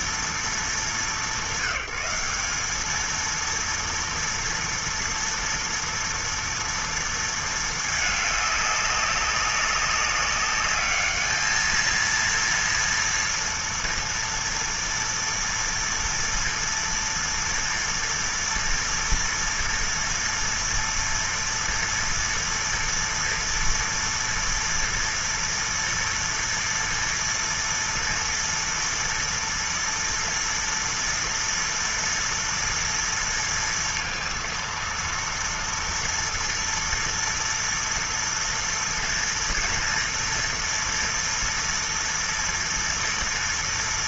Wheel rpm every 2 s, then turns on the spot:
220, 190, 230, 230, 210, 200, 230, 230, 230, 230, 230, 230, 240, 240, 230, 230, 230, 230, 230, 230, 240, 230.
none